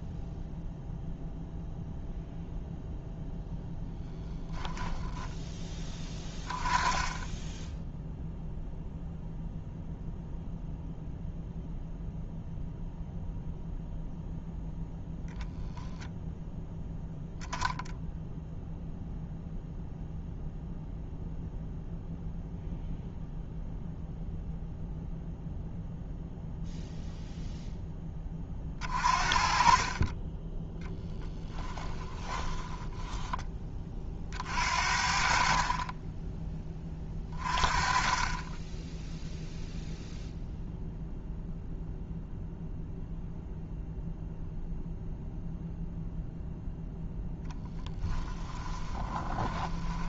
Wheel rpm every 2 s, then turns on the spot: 0, 0, 10, 20, 0, 0, 0, 0, 0, 0, 0, 0, 0, 0, 30, 10, 10, 50, 20, 10, 0, 0, 0, 0, 10.
28-30 32-34 48-50